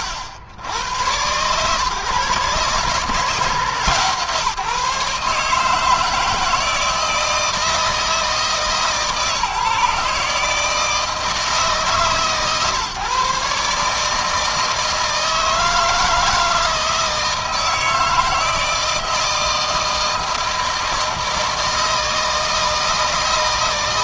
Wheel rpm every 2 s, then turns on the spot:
70, 140, 150, 160, 160, 150, 140, 160, 160, 160, 160, 160.
none